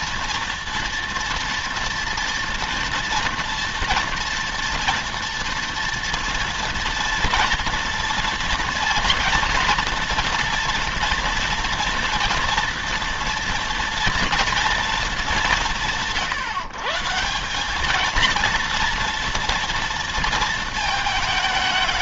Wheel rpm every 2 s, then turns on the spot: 230, 230, 230, 230, 230, 230, 230, 230, 150, 230, 220.
none